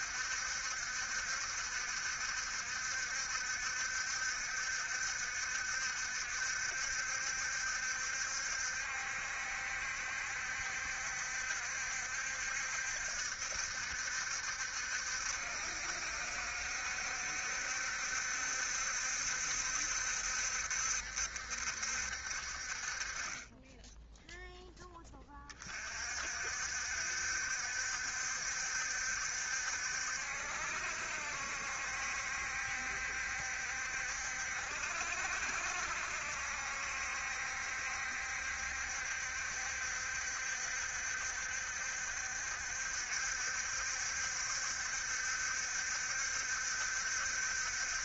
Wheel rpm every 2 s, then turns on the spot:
70, 70, 70, 70, 60, 70, 60, 70, 70, 70, 60, 40, 10, 60, 70, 60, 70, 60, 60, 70, 70, 60, 70, 70.
none